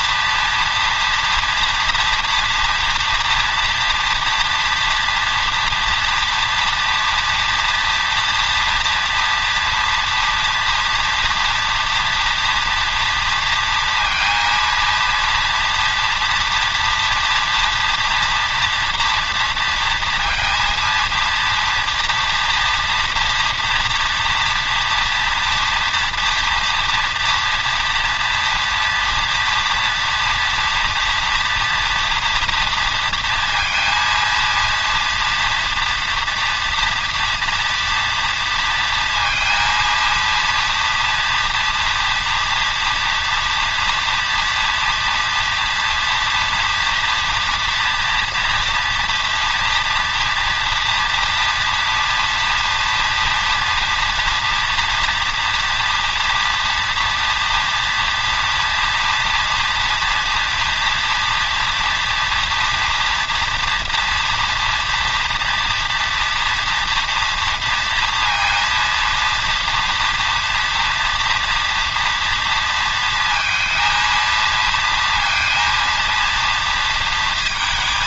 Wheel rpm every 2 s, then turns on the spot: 230, 240, 230, 230, 230, 230, 230, 230, 230, 230, 230, 230, 230, 230, 230, 230, 230, 230, 230, 230, 240, 230, 230, 230, 230, 230, 230, 240, 240, 230, 230, 230, 230, 240, 230, 240, 230, 230, 230.
none